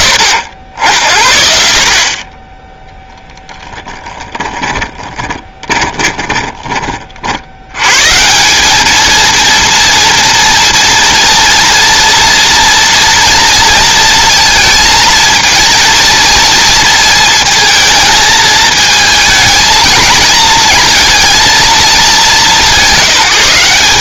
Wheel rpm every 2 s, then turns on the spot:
50, 10, 10, 20, 200, 230, 230, 230, 220, 220, 230, 180.
4-6